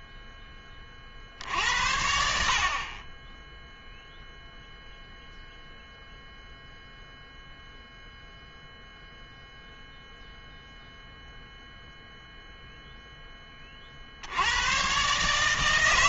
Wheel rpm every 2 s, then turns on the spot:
30, 30, 0, 0, 0, 0, 0, 120.
none